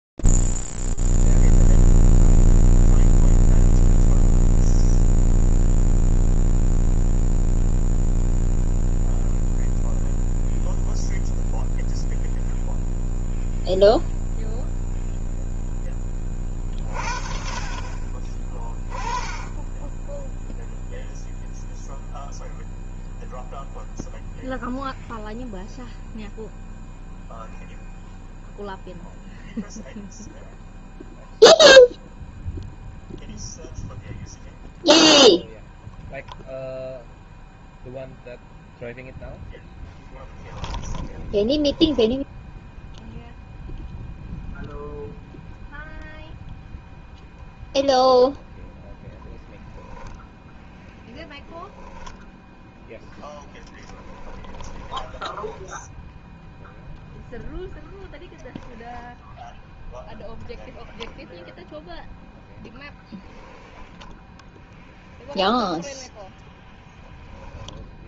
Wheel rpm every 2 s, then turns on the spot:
0, 0, 0, 0, 0, 0, 0, 0, 40, 20, 0, 0, 0, 0, 0, 0, 0, 0, 0, 0, 10, 0, 0, 0, 10, 0, 0, 10, 0, 10, 0, 0, 0, 0.
40-42 54-56